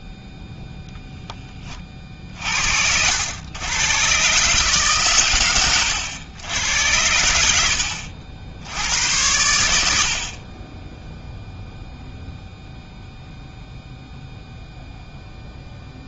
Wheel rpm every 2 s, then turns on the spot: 0, 70, 130, 90, 90, 20, 0, 0.
none